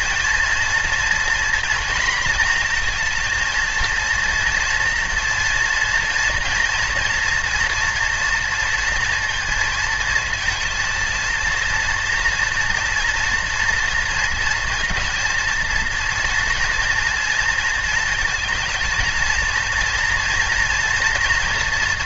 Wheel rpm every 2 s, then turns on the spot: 230, 230, 230, 230, 230, 230, 230, 230, 240, 230, 230.
none